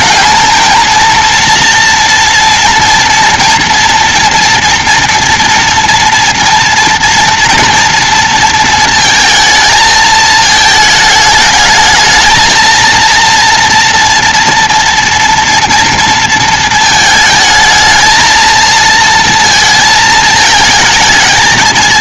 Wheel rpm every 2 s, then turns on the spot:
220, 230, 230, 230, 220, 220, 230, 240, 230, 220, 220.
none